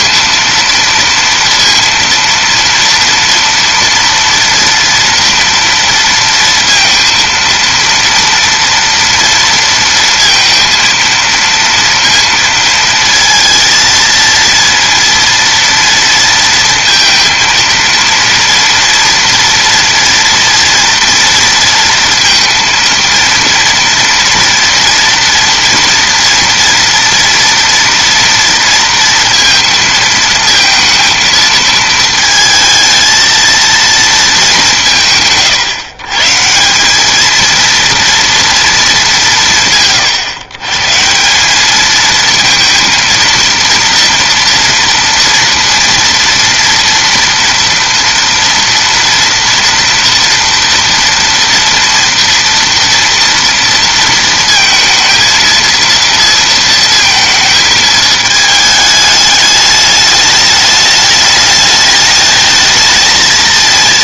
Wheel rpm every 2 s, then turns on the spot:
230, 230, 230, 230, 230, 230, 230, 230, 230, 230, 230, 230, 230, 230, 230, 230, 220, 180, 180, 220, 140, 230, 230, 230, 230, 230, 230, 230, 230, 220, 210, 220.
none